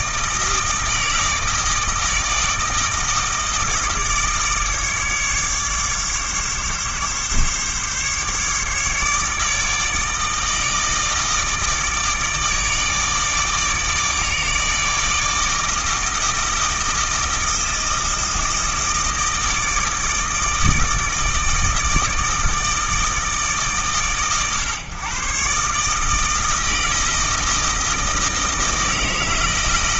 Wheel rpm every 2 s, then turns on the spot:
160, 160, 150, 140, 150, 160, 150, 160, 160, 160, 160, 160, 130, 160, 160.
none